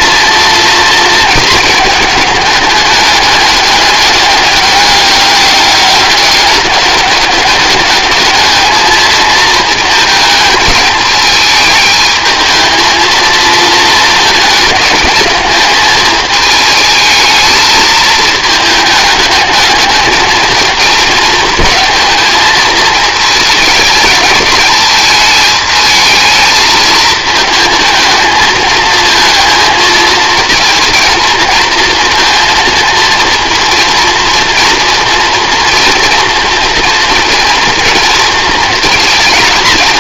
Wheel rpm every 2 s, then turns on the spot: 230, 210, 200, 200, 220, 220, 220, 220, 220, 220, 220, 220, 220, 220, 220, 230, 230, 230, 230, 230.
none